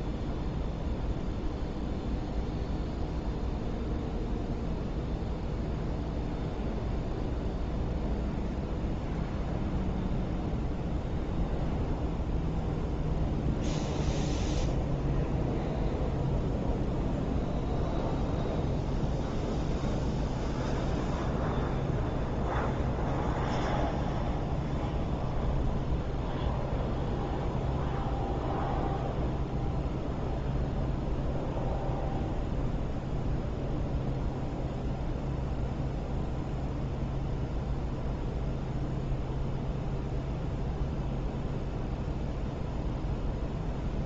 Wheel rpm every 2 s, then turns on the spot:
0, 0, 0, 0, 0, 0, 0, 0, 0, 0, 0, 0, 0, 0, 0, 0, 0, 0, 0, 0, 0, 0.
none